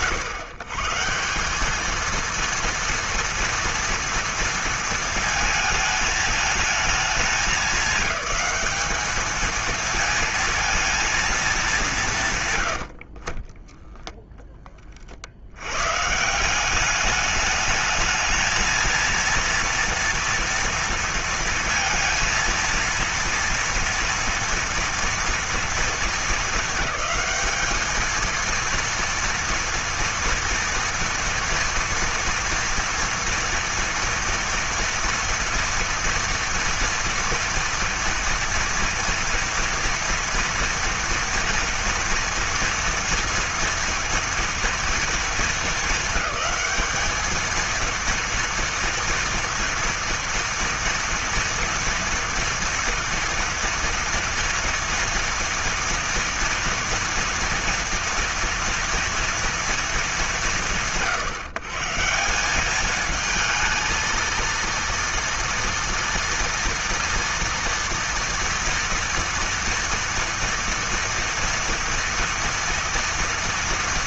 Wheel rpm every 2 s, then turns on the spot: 140, 230, 230, 210, 210, 230, 110, 20, 180, 230, 230, 230, 230, 200, 230, 230, 230, 230, 230, 230, 230, 230, 230, 200, 230, 230, 230, 230, 230, 230, 130, 200, 230, 230, 230, 230, 230.
none